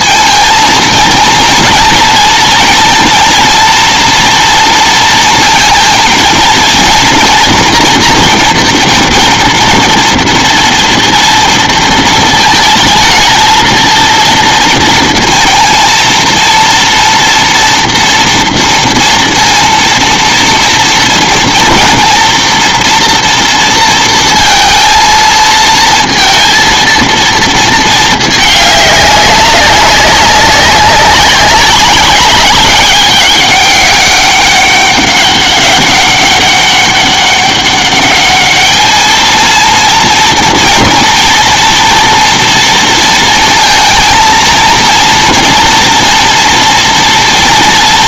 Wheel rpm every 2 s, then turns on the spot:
230, 230, 230, 230, 240, 230, 220, 230, 230, 240, 230, 240, 230, 230, 210, 200, 190, 200, 200, 210, 230, 230, 230, 230.
none